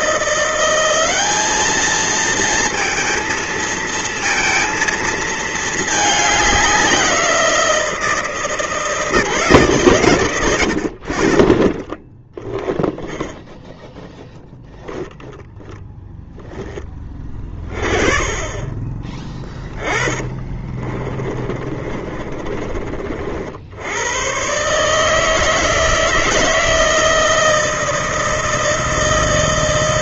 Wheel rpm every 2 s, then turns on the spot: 180, 230, 230, 190, 160, 80, 0, 0, 10, 20, 20, 30, 140, 160, 160.
20-22